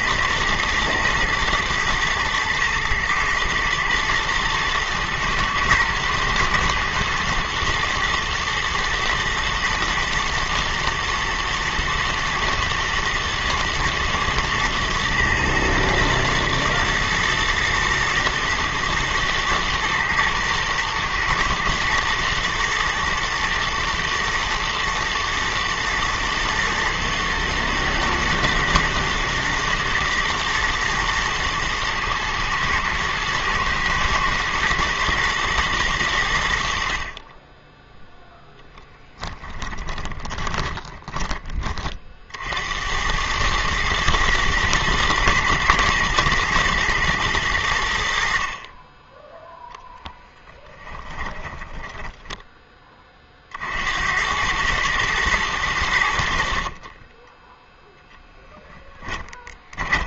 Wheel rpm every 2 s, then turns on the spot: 110, 110, 120, 110, 120, 120, 110, 110, 110, 110, 120, 110, 110, 110, 110, 110, 110, 120, 50, 10, 20, 90, 110, 110, 20, 10, 10, 110, 40, 10.
40-42 50-52 58-60